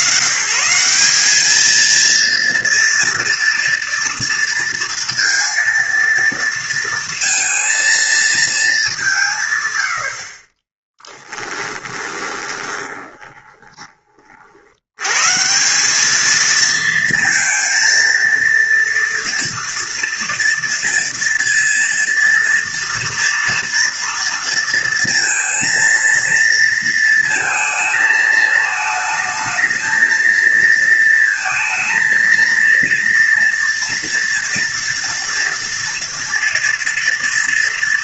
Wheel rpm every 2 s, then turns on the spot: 120, 230, 230, 230, 210, 30, 20, 60, 220, 230, 230, 240, 230, 230, 220, 230, 230, 230, 230.
12-14